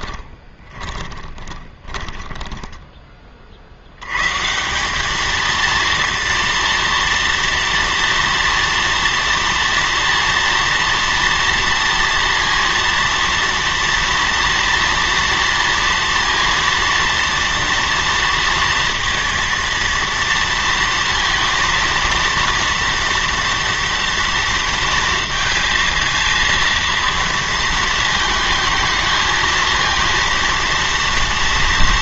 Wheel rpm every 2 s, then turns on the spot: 30, 10, 180, 230, 230, 230, 230, 240, 230, 230, 230, 230, 230, 230, 220, 230.
0-2